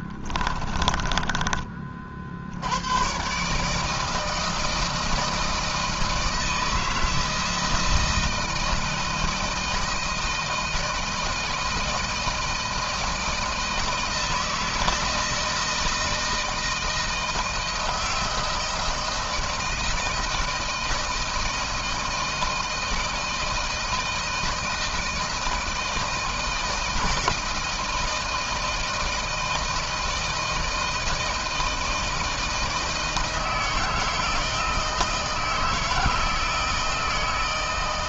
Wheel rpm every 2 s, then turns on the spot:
20, 90, 160, 160, 160, 160, 160, 160, 160, 160, 160, 160, 160, 160, 160, 160, 160, 160, 160.
0-2